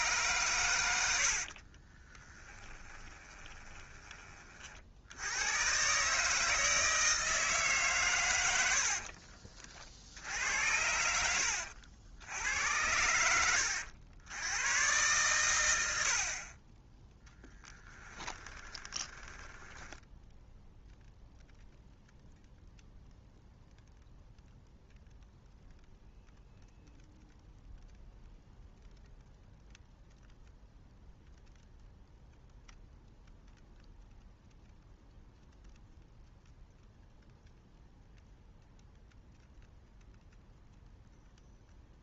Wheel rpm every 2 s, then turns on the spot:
90, 20, 70, 160, 70, 80, 90, 110, 20, 20, 0, 0, 0, 0, 0, 0, 0, 0, 0, 0, 0.
2-4 8-14 18-20